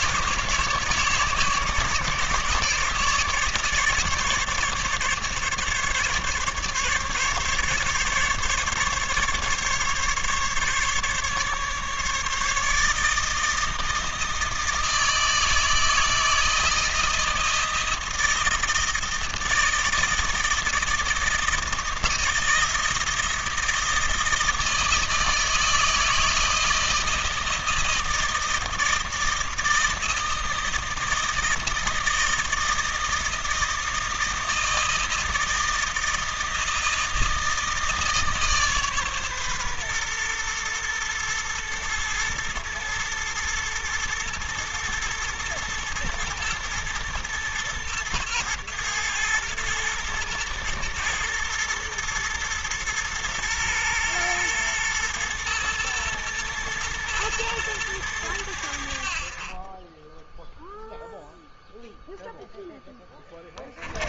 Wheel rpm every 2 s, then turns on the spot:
150, 150, 150, 140, 150, 140, 150, 160, 160, 160, 160, 170, 160, 160, 160, 160, 160, 160, 160, 150, 120, 120, 120, 110, 120, 120, 110, 110, 110, 90, 0, 0.
none